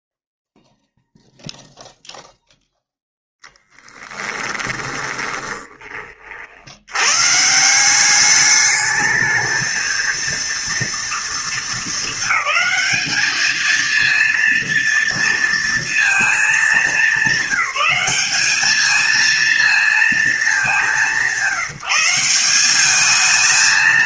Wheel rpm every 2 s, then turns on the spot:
0, 0, 20, 60, 200, 230, 210, 230, 230, 210, 210, 190.
4-6